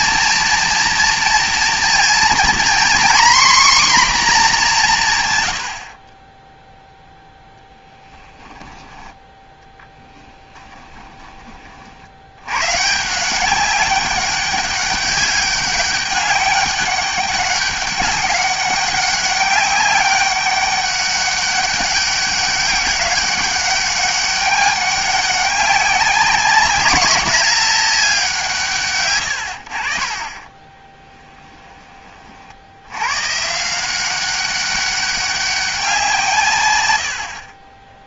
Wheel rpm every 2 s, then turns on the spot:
230, 240, 220, 10, 10, 10, 110, 200, 200, 190, 200, 200, 200, 210, 170, 20, 60, 190, 140.
8-12 30-32